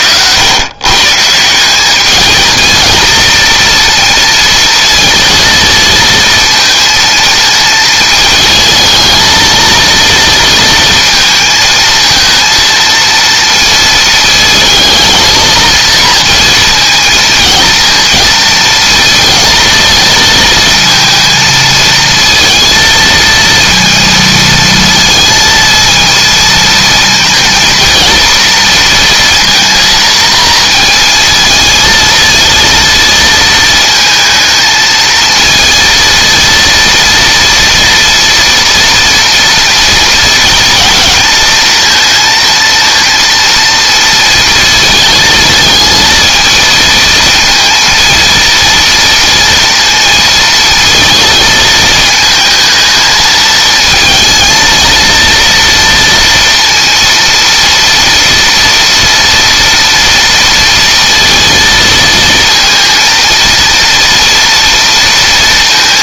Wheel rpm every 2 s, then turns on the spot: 130, 220, 230, 230, 220, 230, 230, 230, 230, 220, 230, 230, 230, 230, 230, 230, 230, 220, 230, 230, 230, 230, 230, 220, 230, 230, 220, 230, 230, 230, 230, 230, 230.
none